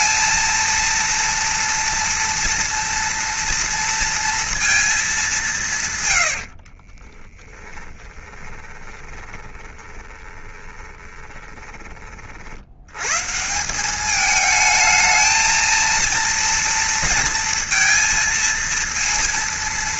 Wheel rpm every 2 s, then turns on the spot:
230, 240, 220, 40, 20, 20, 100, 220, 230, 230.
6-12